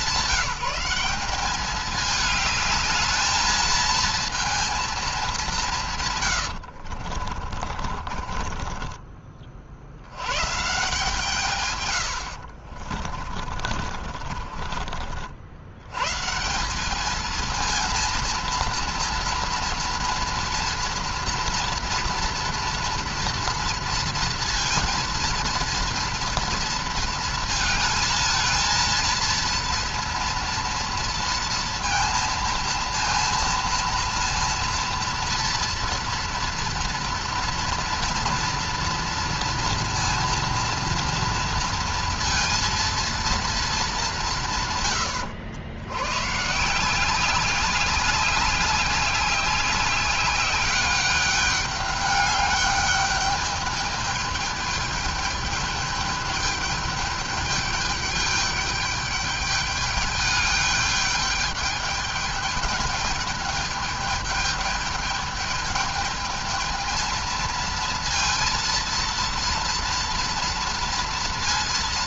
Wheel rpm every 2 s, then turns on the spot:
190, 220, 220, 60, 20, 140, 60, 40, 170, 230, 240, 230, 230, 230, 230, 230, 230, 230, 230, 230, 230, 230, 120, 160, 200, 200, 200, 210, 210, 210, 210, 210, 210, 220, 230, 230.
6-10 12-16